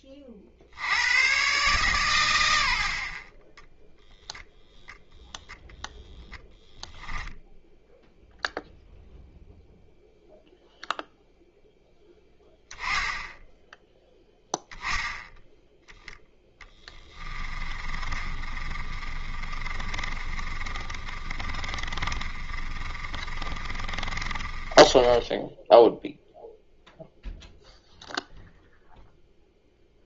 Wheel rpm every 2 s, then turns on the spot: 60, 70, 0, 0, 0, 0, 10, 0, 10, 40, 30, 30, 20, 0, 0.
16-26